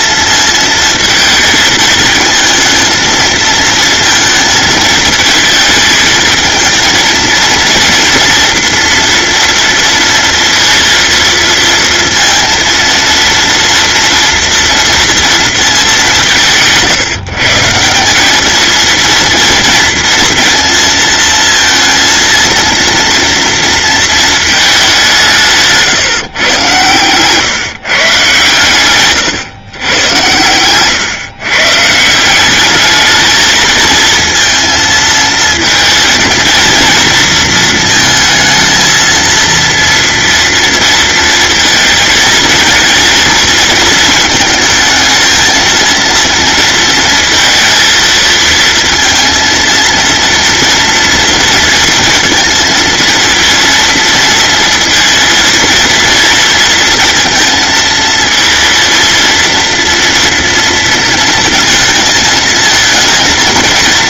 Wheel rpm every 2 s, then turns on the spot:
220, 220, 220, 230, 230, 230, 230, 230, 160, 220, 230, 230, 190, 120, 120, 120, 210, 230, 230, 230, 230, 230, 220, 230, 230, 230, 230, 230, 230, 230, 230, 230.
28-32